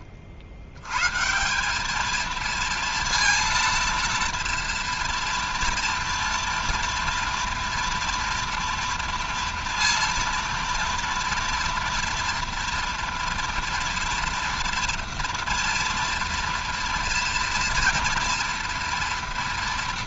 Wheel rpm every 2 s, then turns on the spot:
140, 230, 230, 230, 230, 230, 230, 230, 230, 240.
none